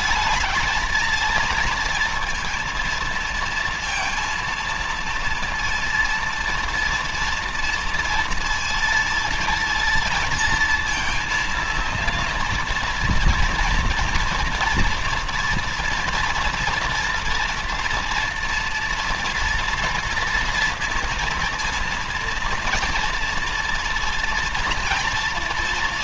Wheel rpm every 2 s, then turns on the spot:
220, 230, 230, 230, 230, 230, 230, 230, 230, 230, 230, 230, 230.
none